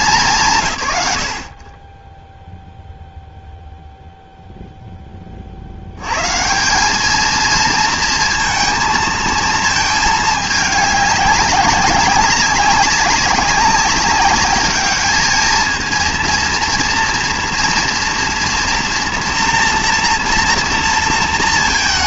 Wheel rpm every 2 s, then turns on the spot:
140, 0, 10, 200, 220, 200, 190, 210, 230, 230, 230.
none